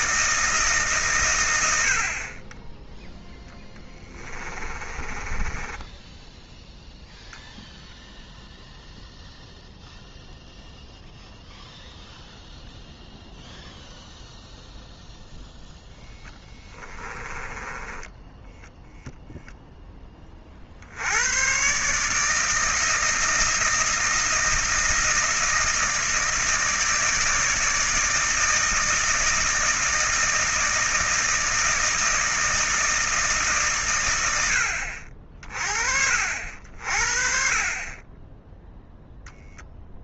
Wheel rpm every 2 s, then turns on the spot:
150, 10, 20, 0, 0, 0, 0, 0, 20, 0, 50, 160, 160, 160, 160, 160, 160, 70, 60, 0.
2-6 16-18